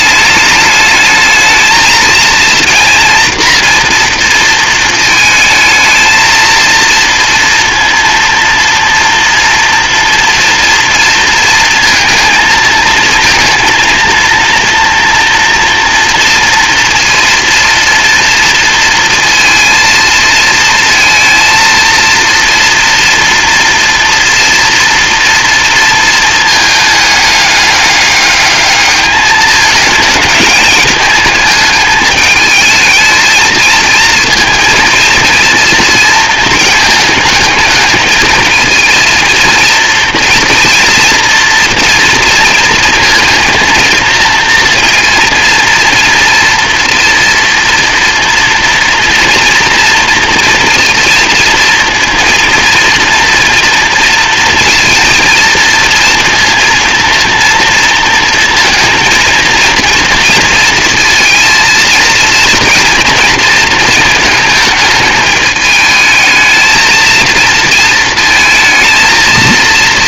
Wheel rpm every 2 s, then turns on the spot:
210, 230, 230, 230, 230, 230, 230, 240, 230, 230, 230, 230, 230, 210, 210, 220, 220, 230, 220, 230, 230, 230, 230, 230, 230, 230, 230, 230, 230, 230, 230, 230, 220, 220, 230.
none